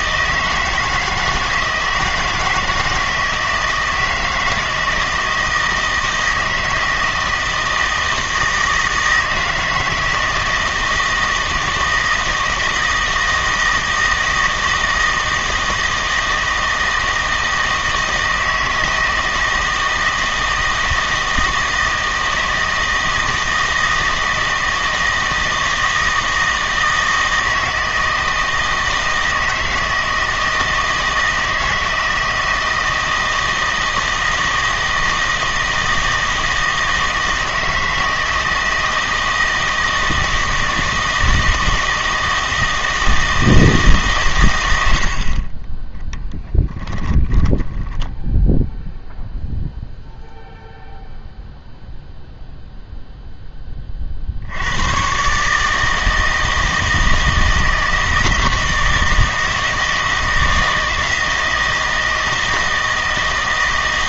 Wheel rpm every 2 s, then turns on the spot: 160, 160, 160, 160, 160, 160, 160, 160, 160, 160, 160, 160, 160, 160, 160, 160, 160, 160, 160, 160, 160, 160, 80, 10, 0, 0, 0, 90, 160, 160, 160, 160.
44-48